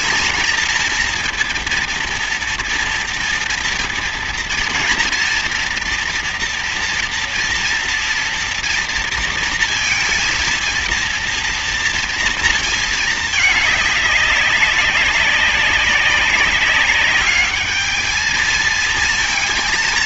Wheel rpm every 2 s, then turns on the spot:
230, 230, 230, 240, 230, 230, 220, 190, 200, 230.
none